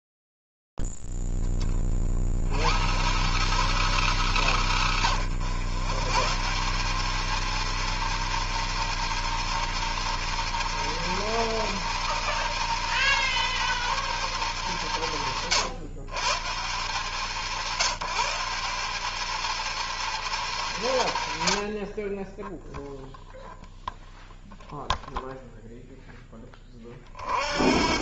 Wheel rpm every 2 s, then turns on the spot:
0, 50, 210, 130, 230, 230, 230, 230, 150, 170, 210, 30, 0, 20.
none